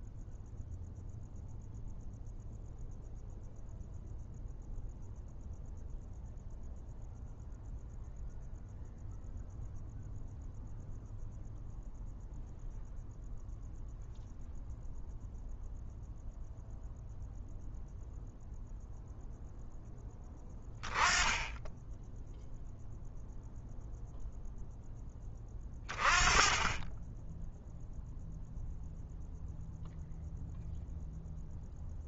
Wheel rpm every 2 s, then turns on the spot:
0, 0, 0, 0, 0, 0, 0, 0, 0, 0, 10, 0, 0, 20, 0, 0.
none